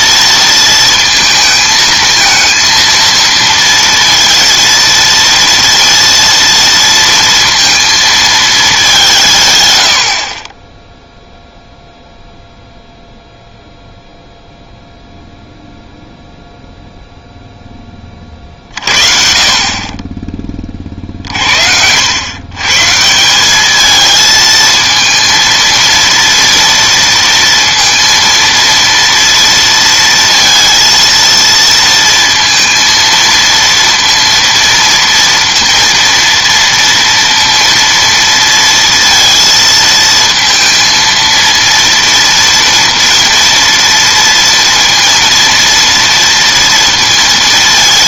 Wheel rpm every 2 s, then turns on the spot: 230, 230, 230, 230, 210, 20, 0, 0, 0, 40, 30, 130, 220, 230, 230, 230, 230, 230, 230, 230, 230, 230, 230, 230.
none